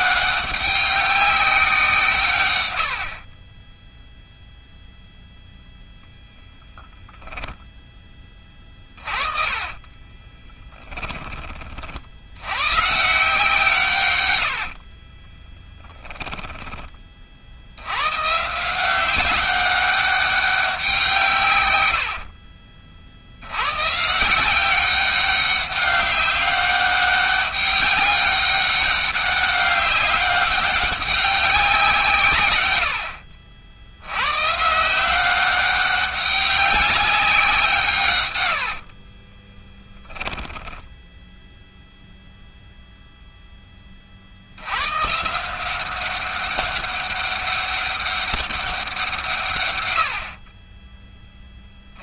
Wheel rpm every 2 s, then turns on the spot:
190, 80, 0, 30, 40, 20, 140, 50, 20, 190, 190, 70, 190, 200, 190, 190, 80, 180, 190, 50, 10, 0, 130, 200, 170, 20.
2-4 8-10 14-16 38-42